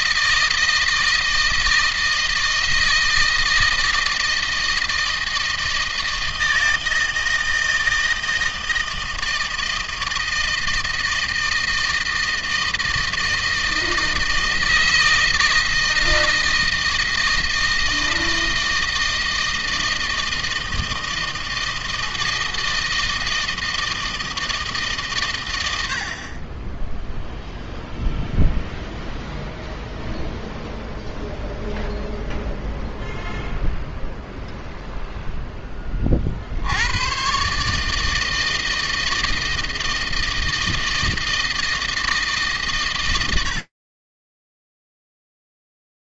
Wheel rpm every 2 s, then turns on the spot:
160, 160, 160, 160, 160, 160, 160, 160, 160, 160, 160, 160, 150, 10, 0, 0, 0, 0, 100, 160, 160, 100, 0.
none